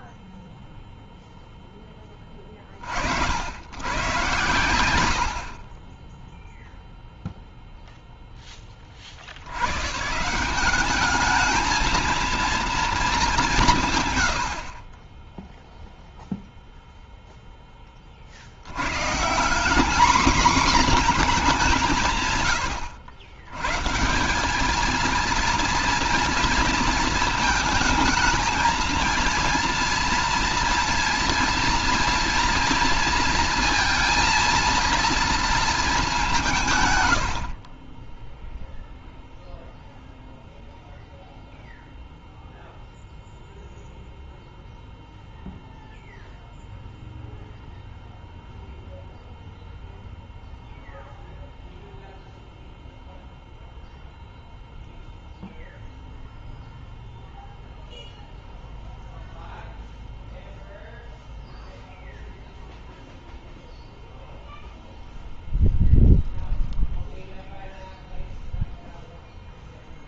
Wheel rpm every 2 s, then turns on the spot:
10, 110, 10, 0, 130, 220, 150, 0, 10, 180, 210, 100, 230, 220, 230, 230, 230, 230, 60, 0, 0, 0, 0, 0, 0, 0, 0, 0, 0, 0, 0, 0, 0, 0, 0.
none